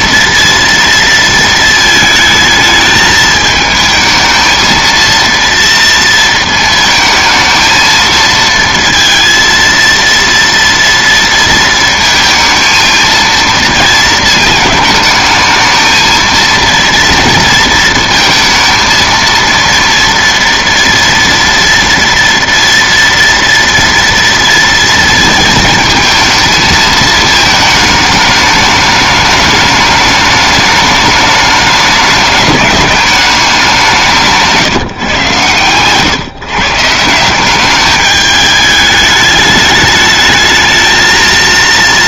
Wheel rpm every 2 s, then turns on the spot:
230, 220, 230, 220, 230, 230, 230, 220, 230, 230, 230, 230, 230, 220, 210, 210, 210, 150, 150, 210, 220.
34-36